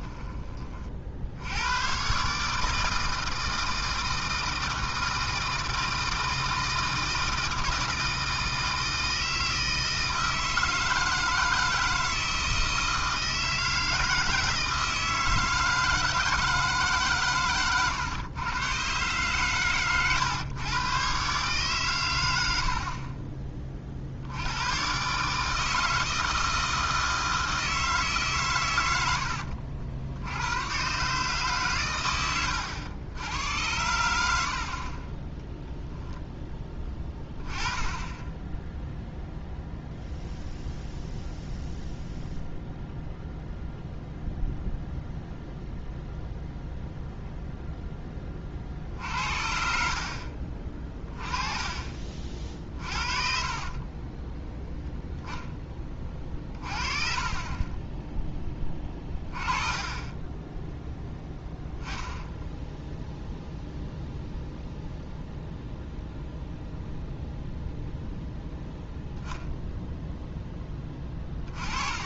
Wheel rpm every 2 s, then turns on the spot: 40, 150, 160, 160, 160, 160, 160, 160, 150, 120, 120, 50, 120, 160, 110, 110, 100, 40, 10, 10, 0, 0, 0, 0, 50, 30, 40, 10, 40, 20, 10, 10, 0, 0, 10, 20.
52-54 62-64